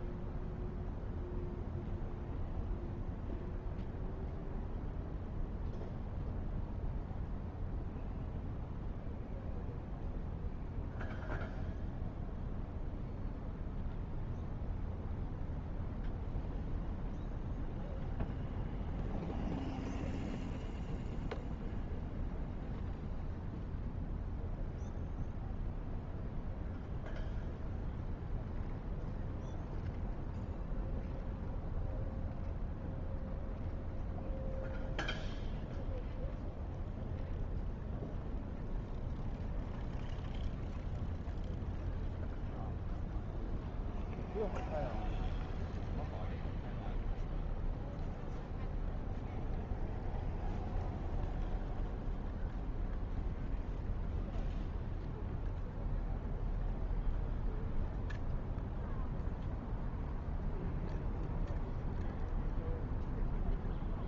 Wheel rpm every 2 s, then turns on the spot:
0, 0, 0, 0, 0, 0, 0, 0, 0, 0, 0, 0, 0, 0, 0, 0, 0, 0, 0, 0, 0, 0, 0, 0, 0, 0, 0, 0, 0, 0, 0, 0.
none